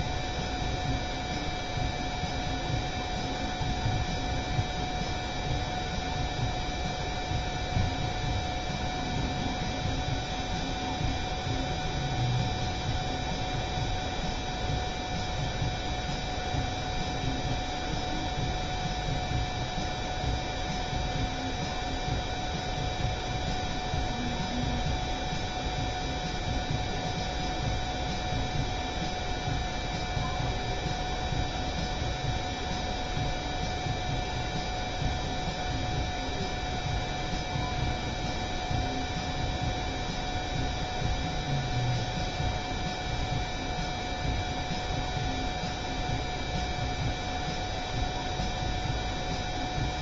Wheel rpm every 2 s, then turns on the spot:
0, 0, 0, 0, 0, 0, 0, 0, 0, 0, 0, 0, 0, 0, 0, 0, 0, 0, 0, 0, 0, 0, 0, 0, 0.
none